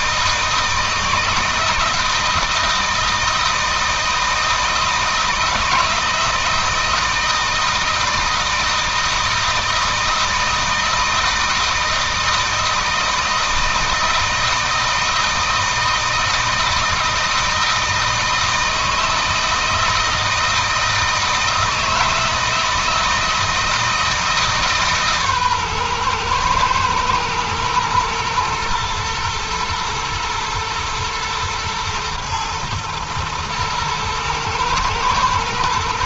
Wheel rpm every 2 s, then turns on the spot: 160, 160, 160, 160, 160, 160, 160, 160, 160, 160, 160, 160, 150, 120, 120, 110, 110, 120.
none